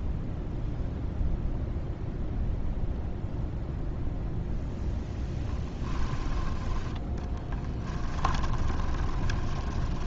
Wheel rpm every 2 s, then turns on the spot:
0, 0, 0, 10, 20.
8-10